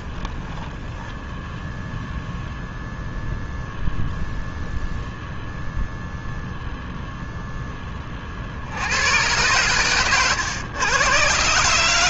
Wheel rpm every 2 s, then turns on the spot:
0, 0, 0, 0, 90, 110.
none